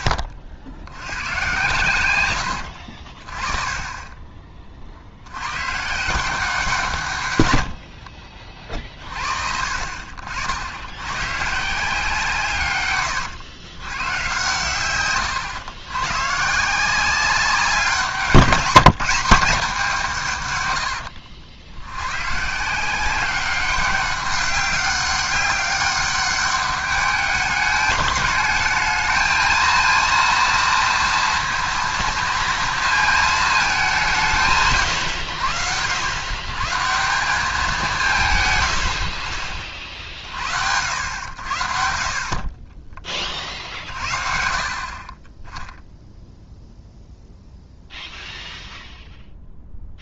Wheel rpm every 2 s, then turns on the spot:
80, 80, 30, 180, 40, 80, 130, 110, 160, 180, 120, 170, 200, 200, 220, 230, 230, 150, 140, 110, 70, 30, 40, 0, 0.
2-4 20-22